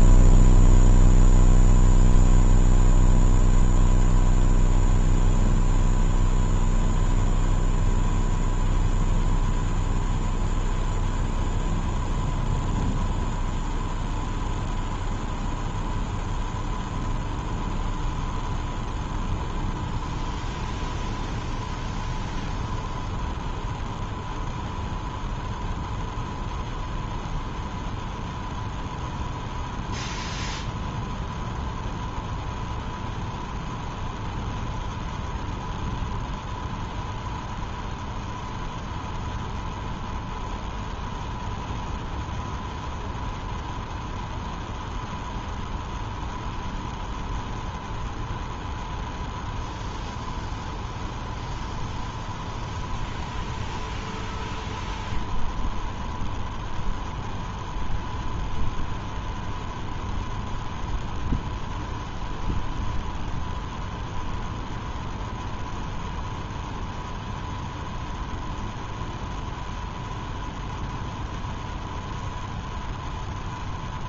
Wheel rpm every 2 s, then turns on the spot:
0, 0, 0, 0, 0, 0, 0, 0, 0, 0, 0, 0, 0, 0, 0, 0, 0, 0, 0, 0, 0, 0, 0, 0, 0, 0, 0, 0, 0, 0, 0, 0, 0, 0, 0, 0, 0.
none